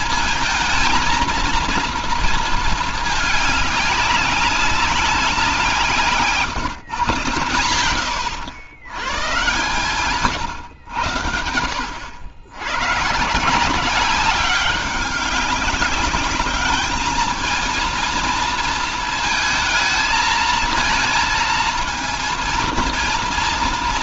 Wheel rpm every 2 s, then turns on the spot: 230, 220, 190, 130, 100, 130, 110, 190, 210, 230, 230, 230.
none